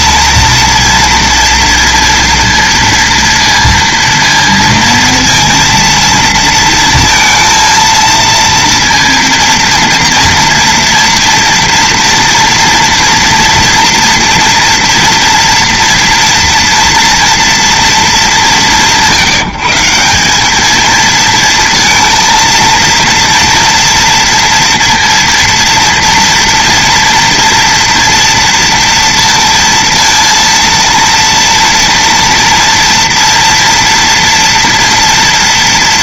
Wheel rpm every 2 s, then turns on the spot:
230, 230, 230, 230, 230, 230, 240, 230, 230, 160, 220, 230, 230, 230, 230, 230, 230, 230.
none